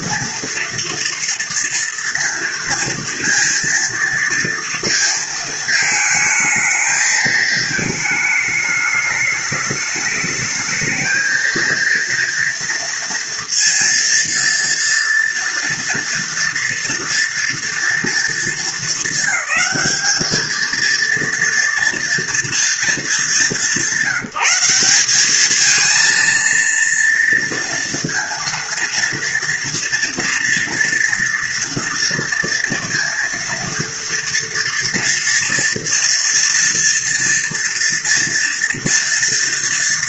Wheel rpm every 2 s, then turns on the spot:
240, 230, 230, 220, 210, 220, 230, 240, 230, 220, 230, 220, 200, 230, 230, 230, 230, 230, 230, 230.
none